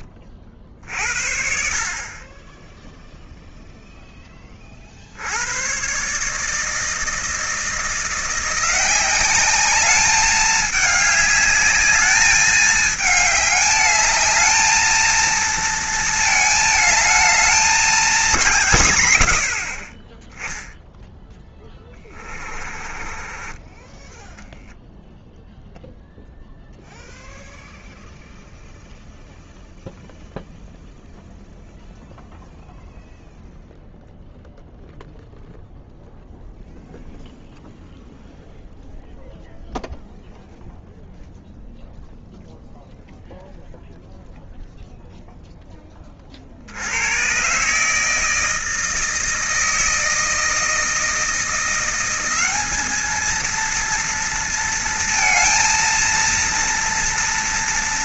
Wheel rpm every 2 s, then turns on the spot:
50, 10, 50, 160, 180, 210, 210, 220, 220, 170, 0, 30, 0, 0, 0, 0, 0, 0, 0, 0, 0, 0, 0, 70, 160, 160, 200, 230, 230.
22-24